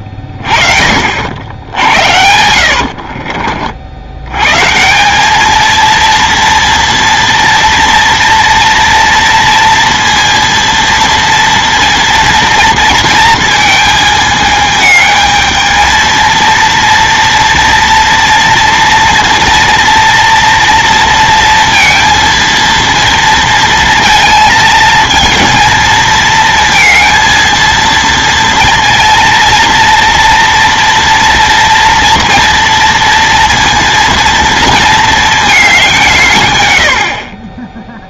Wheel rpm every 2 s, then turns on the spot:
30, 80, 140, 230, 230, 230, 230, 220, 230, 230, 230, 230, 220, 220, 230, 230, 230, 230, 110.
2-4